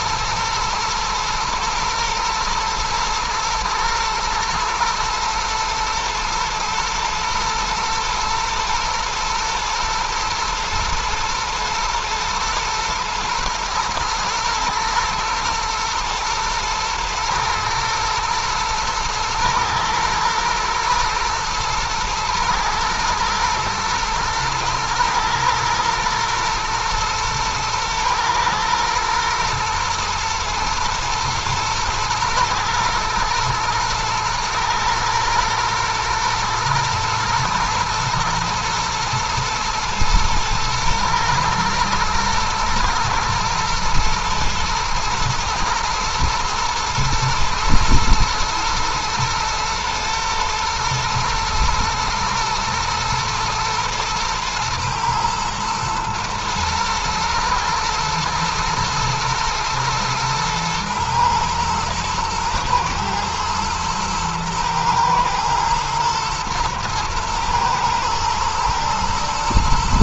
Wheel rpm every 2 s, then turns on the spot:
120, 110, 120, 110, 110, 120, 120, 120, 110, 110, 110, 110, 110, 120, 120, 120, 110, 120, 120, 110, 110, 110, 120, 110, 110, 120, 110, 110, 110, 110, 120, 110, 120, 120, 120.
none